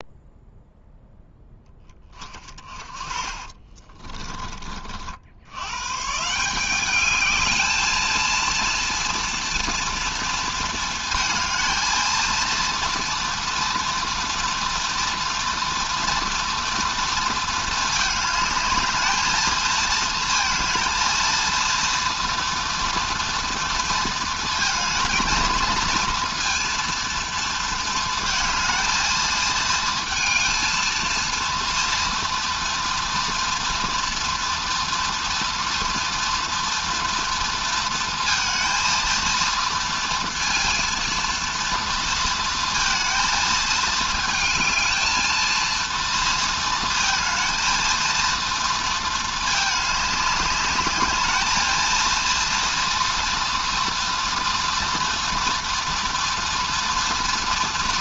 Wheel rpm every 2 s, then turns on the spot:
0, 30, 50, 200, 230, 230, 230, 240, 230, 220, 230, 230, 230, 230, 220, 230, 230, 240, 230, 220, 230, 230, 220, 230, 220, 210, 230, 230, 230.
2-4